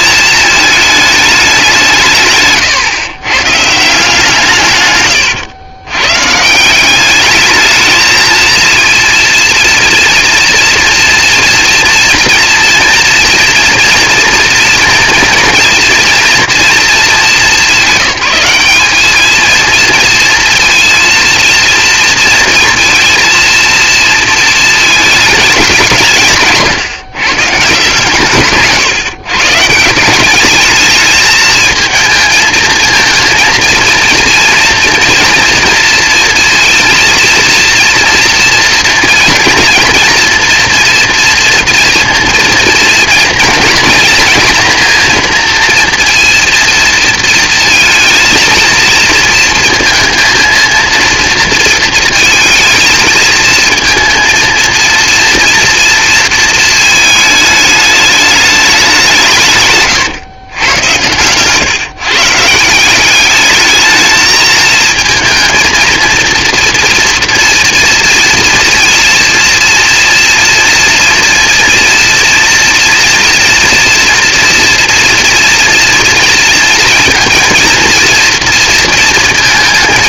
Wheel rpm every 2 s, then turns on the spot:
210, 140, 120, 210, 230, 240, 230, 230, 210, 210, 230, 230, 220, 150, 130, 210, 230, 230, 230, 240, 230, 220, 230, 230, 230, 230, 220, 230, 220, 160, 110, 200, 230, 230, 230, 230, 230, 240, 230, 230.
none